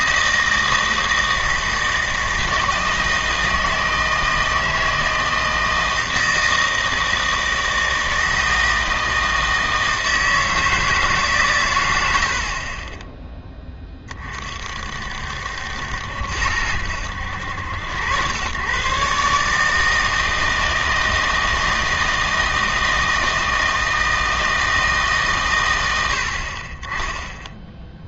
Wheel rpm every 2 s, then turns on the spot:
160, 160, 160, 160, 160, 160, 30, 50, 80, 120, 160, 160, 160, 30.
12-14